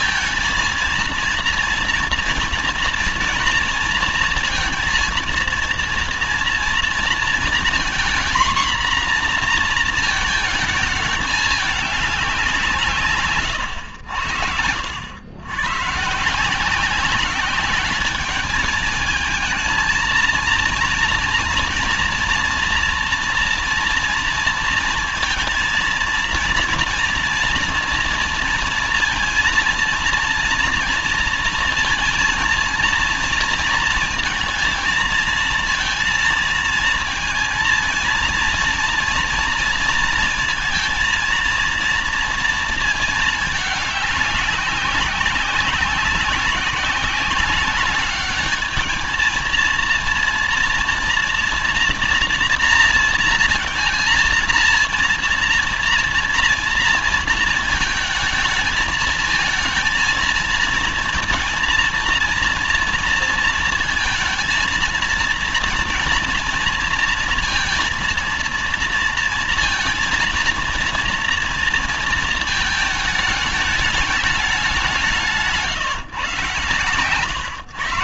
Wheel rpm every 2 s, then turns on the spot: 230, 230, 230, 230, 240, 220, 180, 80, 170, 210, 230, 230, 230, 230, 230, 230, 230, 230, 230, 230, 230, 230, 200, 190, 210, 230, 230, 230, 230, 220, 230, 230, 230, 230, 230, 230, 220, 190, 120.
none